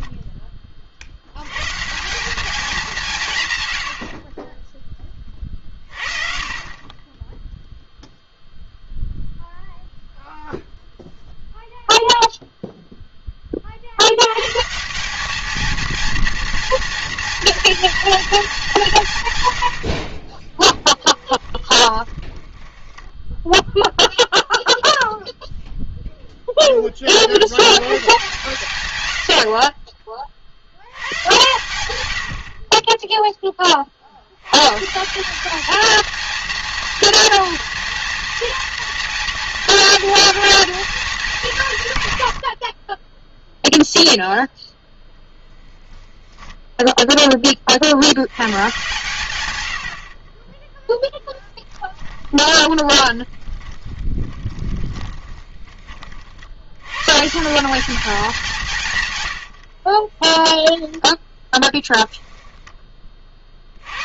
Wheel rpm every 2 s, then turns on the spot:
20, 190, 10, 40, 0, 0, 0, 150, 230, 220, 20, 10, 0, 10, 120, 70, 50, 120, 230, 230, 230, 60, 0, 0, 130, 20, 20, 10, 90, 180, 0, 10.
20-24 52-56 62-64